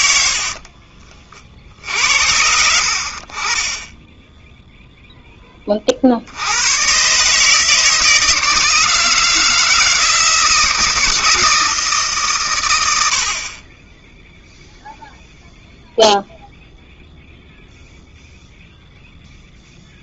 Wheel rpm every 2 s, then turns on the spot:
70, 70, 0, 90, 160, 160, 120, 0, 0, 0.
0-2